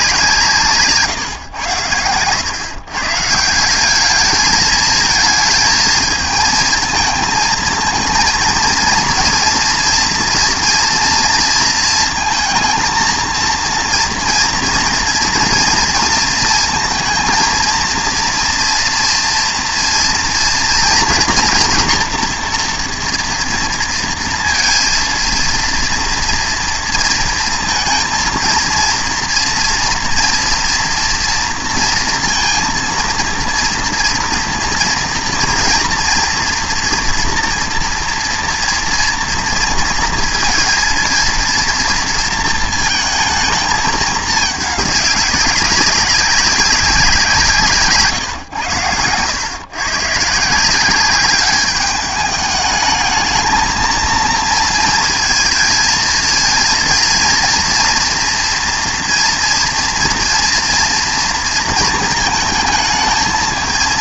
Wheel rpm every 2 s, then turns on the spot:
160, 130, 220, 220, 230, 230, 230, 230, 220, 240, 230, 230, 230, 230, 230, 230, 230, 230, 230, 230, 230, 230, 210, 200, 120, 170, 210, 230, 230, 230, 230, 220.
none